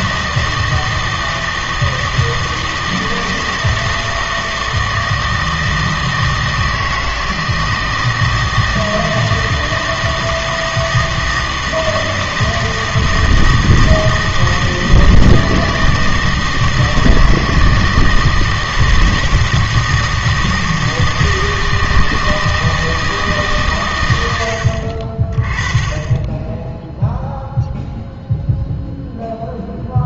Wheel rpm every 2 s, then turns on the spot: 160, 160, 160, 160, 160, 160, 160, 160, 160, 160, 160, 160, 60, 10, 0.
none